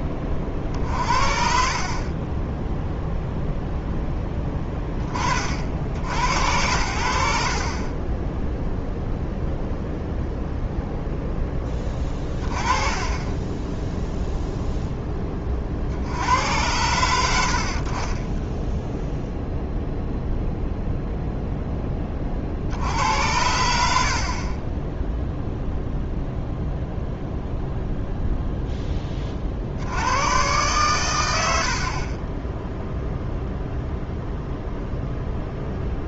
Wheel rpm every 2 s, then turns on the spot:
50, 0, 20, 110, 0, 0, 30, 0, 90, 0, 0, 70, 20, 0, 10, 110, 0, 0.
none